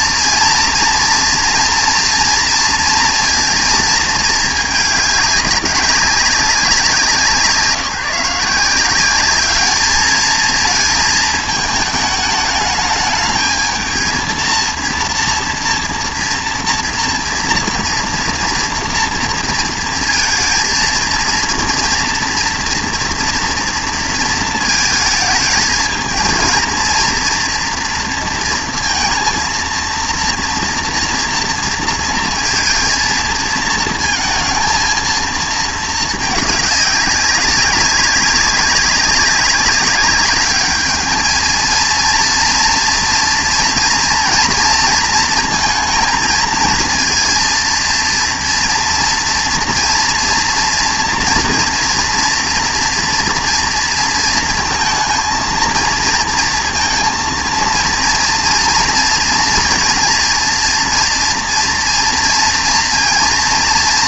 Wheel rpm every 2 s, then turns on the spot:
230, 230, 210, 190, 170, 220, 210, 230, 230, 230, 230, 230, 220, 220, 230, 230, 230, 230, 210, 190, 210, 230, 230, 220, 230, 230, 230, 230, 230, 240, 230, 230.
none